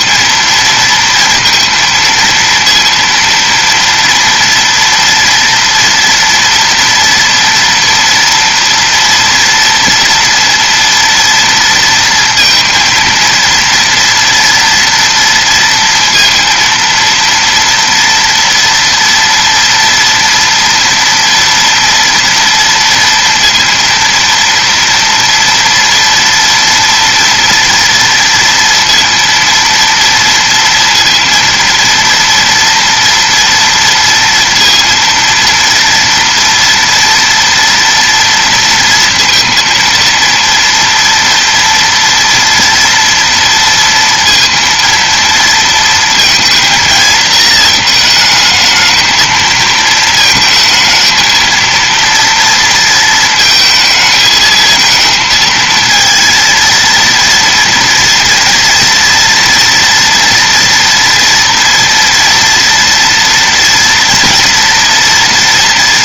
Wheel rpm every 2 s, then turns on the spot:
230, 230, 230, 240, 240, 230, 230, 230, 230, 230, 240, 230, 230, 230, 230, 230, 230, 230, 230, 230, 230, 230, 230, 220, 220, 220, 220, 220, 240, 240, 230, 230, 230.
none